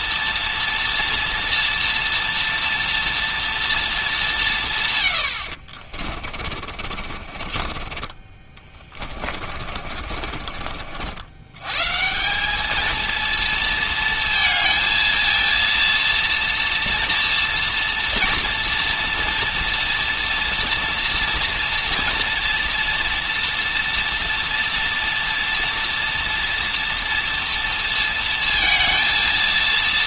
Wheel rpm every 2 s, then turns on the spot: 230, 230, 150, 40, 20, 50, 210, 230, 230, 230, 230, 230, 230, 230, 230.
6-10